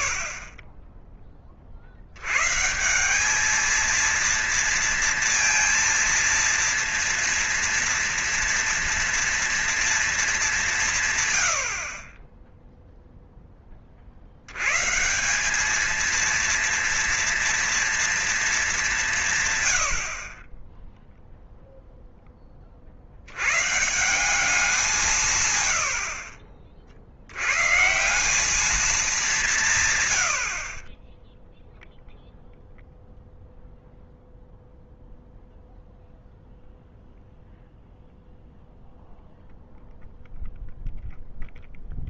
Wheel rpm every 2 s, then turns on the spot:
30, 130, 230, 230, 240, 180, 10, 100, 230, 210, 30, 20, 160, 50, 200, 60, 0, 0, 0, 0, 0.
none